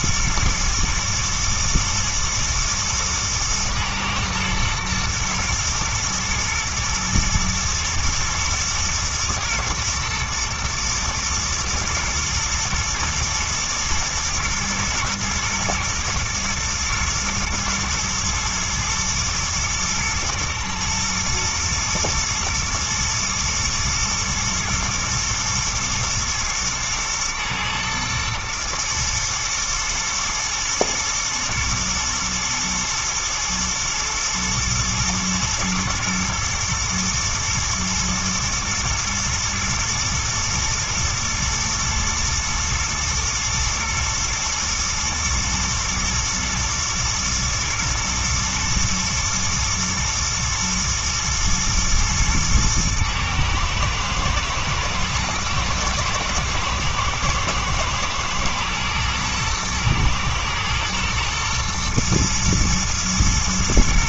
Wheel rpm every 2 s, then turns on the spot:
120, 110, 120, 110, 110, 110, 120, 120, 110, 110, 110, 110, 110, 110, 110, 110, 110, 110, 110, 110, 120, 110, 120, 110, 120, 110, 110, 110, 110, 120, 120, 110.
none